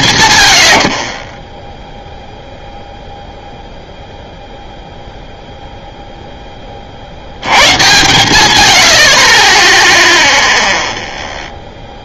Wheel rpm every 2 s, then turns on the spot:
0, 0, 20, 90, 0, 70.
none